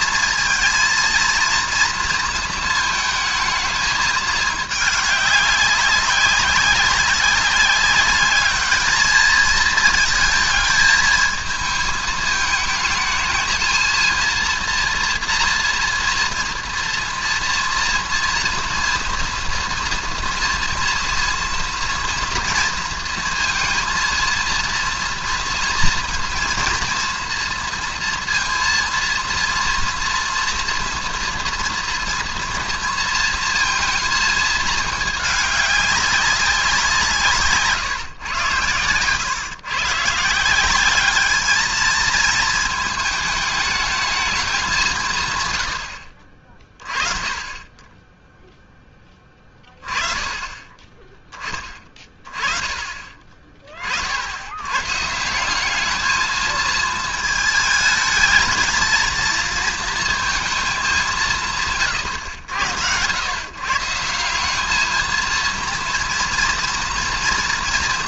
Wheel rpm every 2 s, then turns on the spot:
230, 230, 210, 190, 210, 220, 220, 230, 240, 230, 230, 230, 230, 230, 230, 240, 230, 220, 190, 110, 180, 220, 190, 40, 0, 20, 30, 110, 220, 220, 210, 90, 210, 230.
none